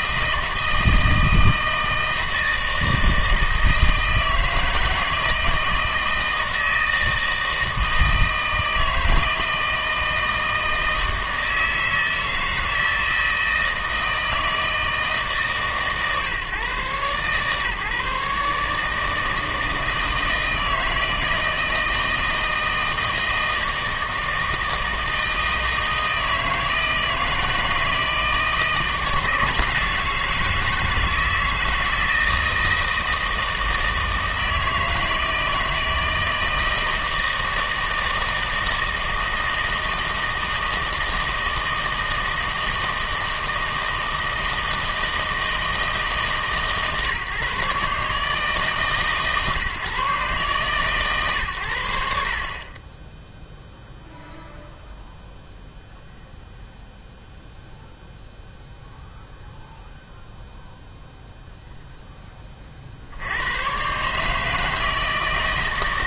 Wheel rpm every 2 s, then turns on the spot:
160, 160, 160, 160, 160, 160, 160, 160, 130, 150, 160, 160, 160, 160, 160, 160, 160, 160, 160, 160, 160, 160, 160, 140, 150, 140, 30, 0, 0, 0, 0, 40, 160.
none